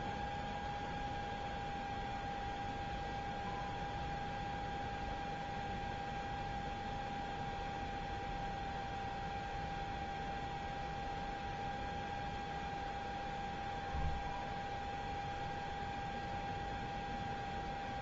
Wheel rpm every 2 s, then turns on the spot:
0, 0, 0, 0, 0, 0, 0, 0, 0.
none